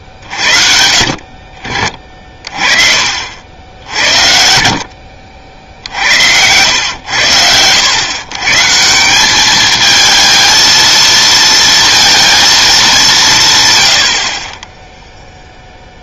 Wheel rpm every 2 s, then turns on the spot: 50, 40, 60, 100, 150, 220, 220, 20.
none